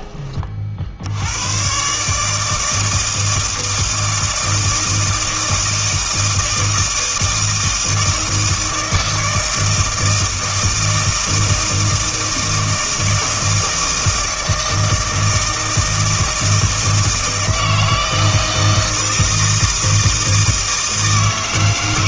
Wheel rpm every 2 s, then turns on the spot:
50, 160, 160, 160, 160, 160, 160, 160, 160, 160, 160.
none